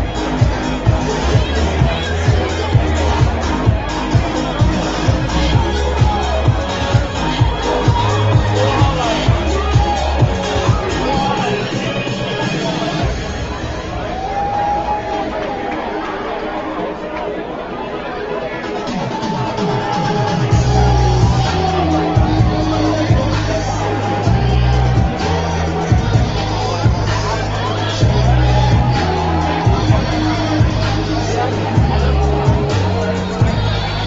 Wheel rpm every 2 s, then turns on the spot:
0, 0, 0, 0, 0, 0, 0, 0, 0, 0, 0, 0, 0, 0, 0, 0, 0.
none